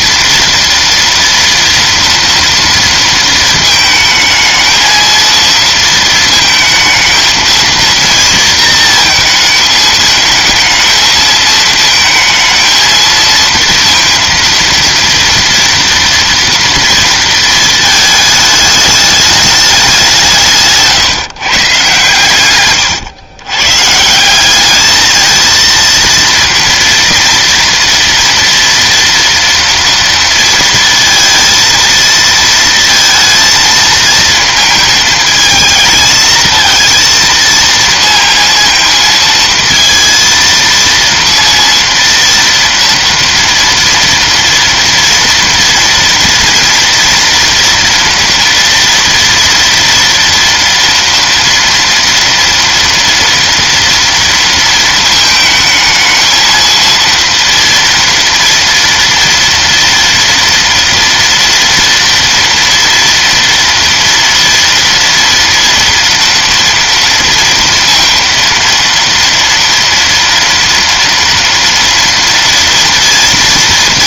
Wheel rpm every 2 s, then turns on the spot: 230, 230, 220, 220, 230, 220, 230, 230, 230, 210, 140, 120, 200, 230, 230, 230, 230, 220, 220, 230, 230, 230, 230, 230, 230, 230, 230, 230, 230, 230, 230, 230, 230, 230, 230, 230, 230.
20-24